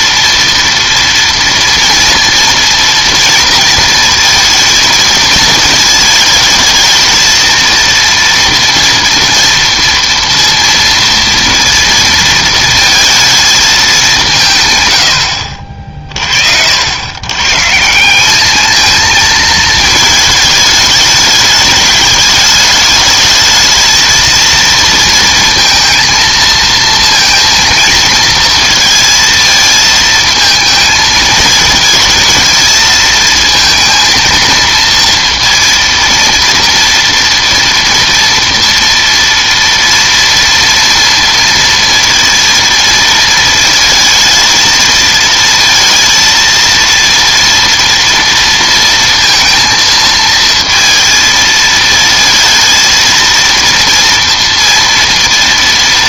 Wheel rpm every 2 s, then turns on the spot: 230, 230, 230, 220, 230, 230, 230, 150, 70, 220, 220, 210, 230, 230, 230, 220, 220, 230, 230, 230, 230, 230, 220, 230, 230, 230, 230, 230.
none